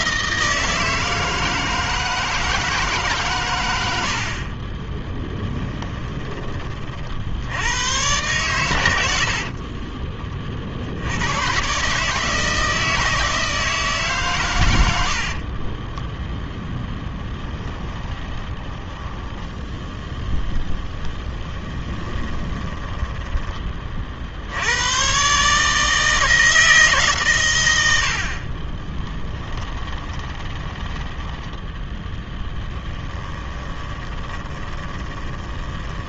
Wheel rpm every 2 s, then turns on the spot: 160, 160, 30, 50, 90, 50, 160, 90, 10, 10, 10, 10, 90, 150, 30, 10, 10, 10.
4-6 16-24 28-36